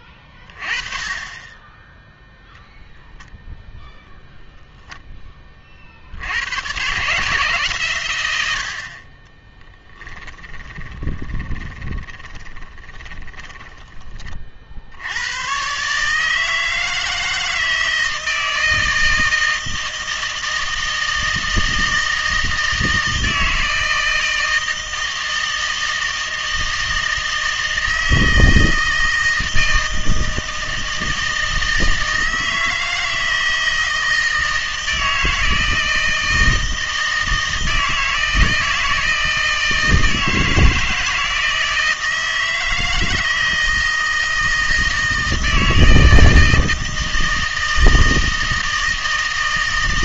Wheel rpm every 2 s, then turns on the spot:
30, 0, 0, 120, 60, 20, 30, 60, 160, 160, 160, 160, 160, 160, 160, 160, 160, 160, 160, 160, 160, 160, 160, 160, 160.
10-14